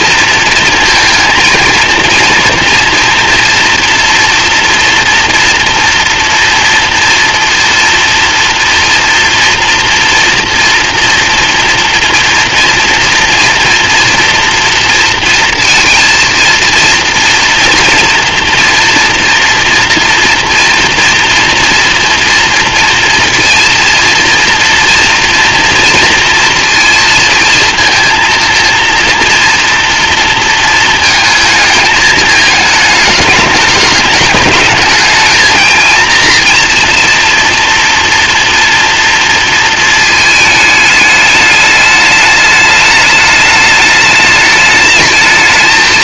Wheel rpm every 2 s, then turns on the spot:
230, 240, 230, 230, 230, 230, 230, 230, 230, 230, 230, 230, 230, 230, 230, 220, 220, 210, 240, 230, 210, 210, 210.
none